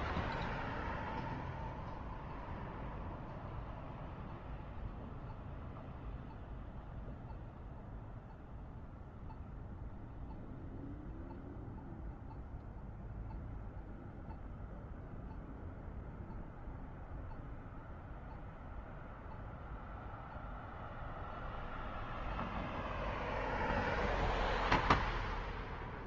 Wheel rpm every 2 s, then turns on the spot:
0, 0, 0, 0, 0, 0, 0, 0, 0, 0, 0, 0, 0.
none